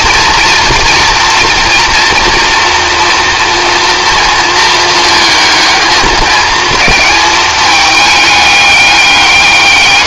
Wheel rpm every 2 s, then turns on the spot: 230, 240, 220, 220, 200.
none